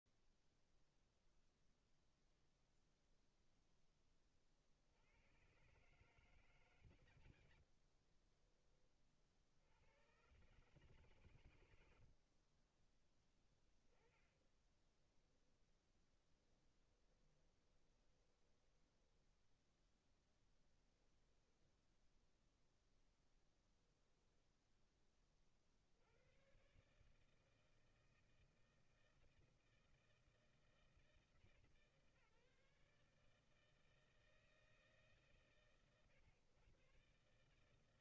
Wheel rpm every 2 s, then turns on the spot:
50, 140, 20, 130, 40, 30, 10, 20, 0, 0, 0, 50, 160, 160, 160, 150, 130, 130, 160.
8-16